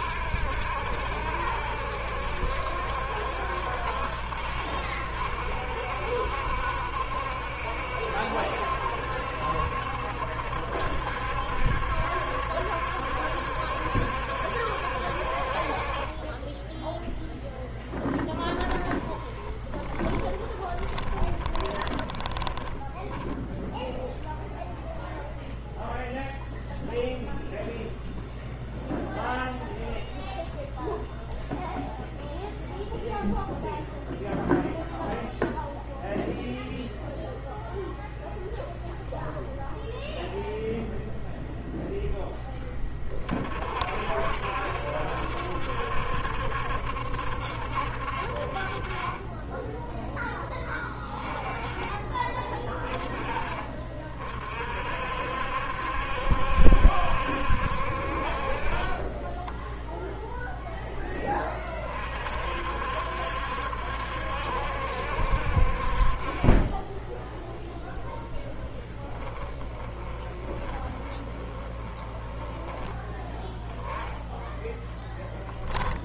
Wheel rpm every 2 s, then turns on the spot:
70, 70, 70, 70, 70, 70, 70, 60, 10, 20, 20, 10, 0, 0, 0, 0, 0, 0, 0, 0, 0, 20, 70, 70, 40, 10, 30, 50, 70, 30, 10, 60, 70, 20, 20, 20, 10, 10.
16-24 66-72 74-76